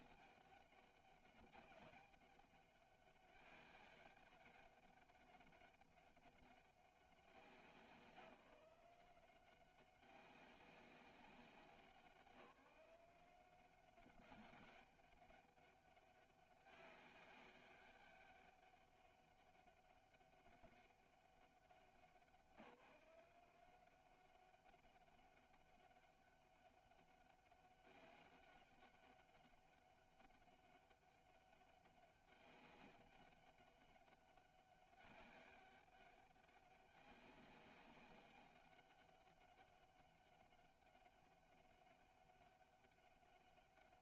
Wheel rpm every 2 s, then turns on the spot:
200, 200, 190, 200, 180, 190, 180, 200, 200, 200, 200, 180, 200, 200, 200, 200, 200, 190, 200, 190, 200, 200.
none